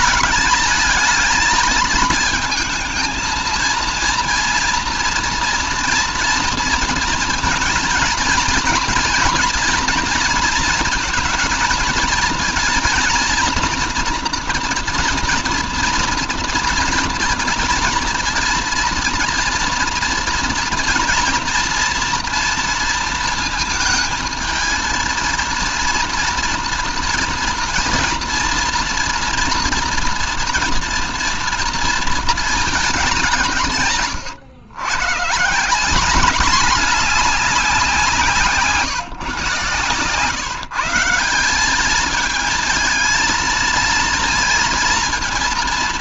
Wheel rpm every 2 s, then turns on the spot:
220, 220, 230, 230, 230, 230, 230, 240, 230, 230, 230, 230, 230, 240, 230, 230, 210, 110, 210, 160, 160, 220, 230.
none